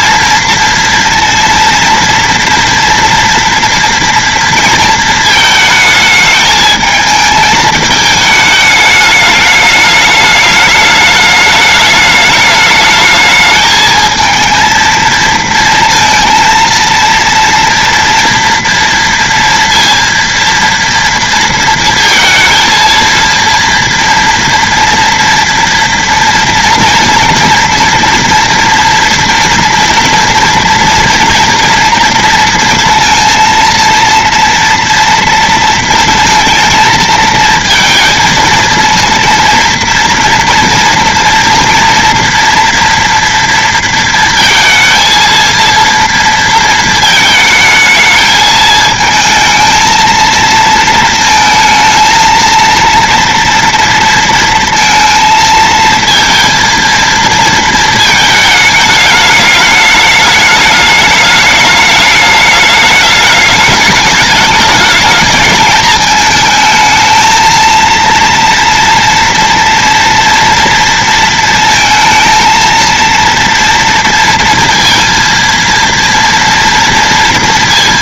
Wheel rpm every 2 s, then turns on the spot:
230, 230, 230, 220, 220, 210, 210, 220, 230, 230, 230, 230, 230, 230, 230, 230, 230, 230, 230, 230, 230, 240, 230, 230, 220, 220, 230, 230, 230, 220, 220, 210, 210, 220, 230, 230, 230, 230, 230.
none